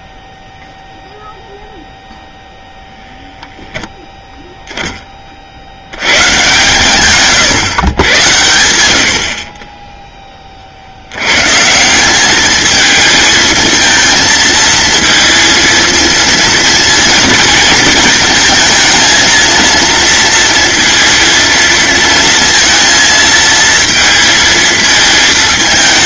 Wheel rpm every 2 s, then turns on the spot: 0, 10, 10, 140, 70, 70, 220, 230, 220, 230, 230, 230, 220.
none